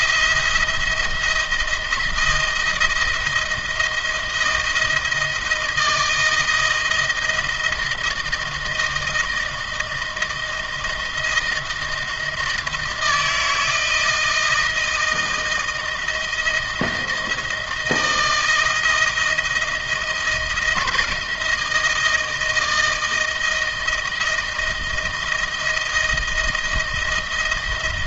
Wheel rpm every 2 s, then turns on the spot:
170, 160, 160, 170, 160, 170, 170, 160, 160, 160, 160, 160, 170, 160.
none